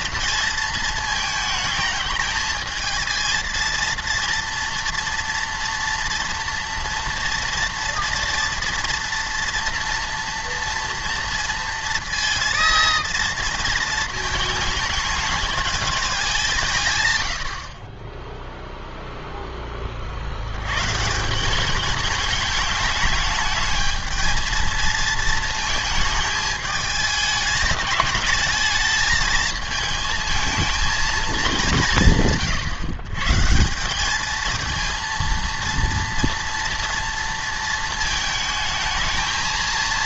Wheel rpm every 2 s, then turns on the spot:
220, 220, 230, 240, 230, 230, 230, 220, 150, 0, 110, 210, 230, 210, 220, 220, 120, 230, 230, 220.
none